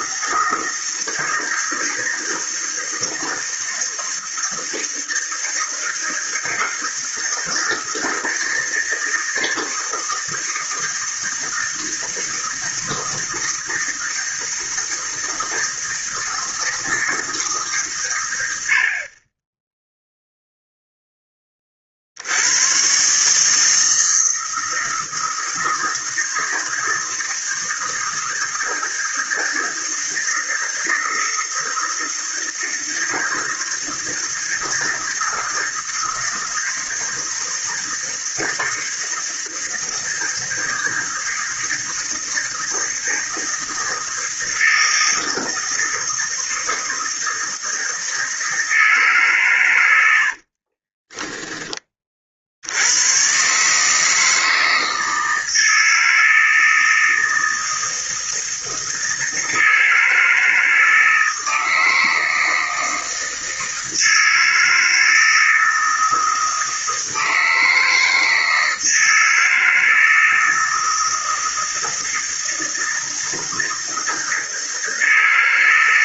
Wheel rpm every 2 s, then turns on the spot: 160, 160, 160, 160, 160, 160, 160, 160, 160, 70, 0, 110, 160, 160, 160, 160, 160, 160, 160, 160, 160, 160, 160, 160, 160, 40, 80, 160, 160, 160, 160, 160, 160, 160, 160, 160, 160, 160.
50-52